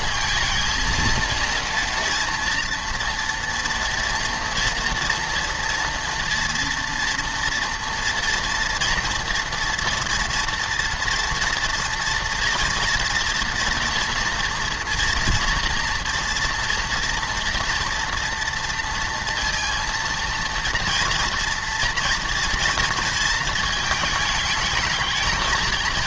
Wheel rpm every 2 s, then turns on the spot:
230, 240, 230, 230, 230, 230, 230, 240, 230, 230, 230, 230, 220.
none